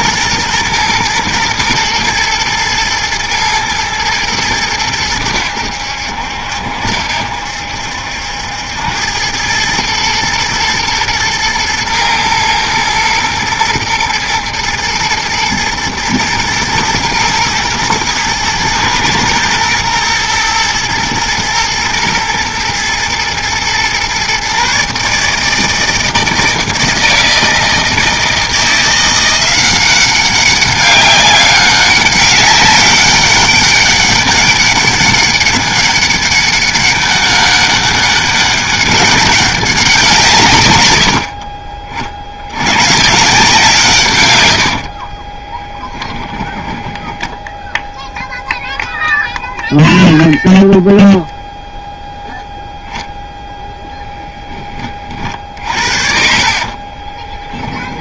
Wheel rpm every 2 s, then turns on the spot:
120, 120, 100, 70, 90, 110, 120, 110, 120, 110, 120, 120, 140, 160, 170, 200, 200, 200, 200, 200, 100, 110, 70, 10, 0, 0, 0, 30, 40.
44-48 56-58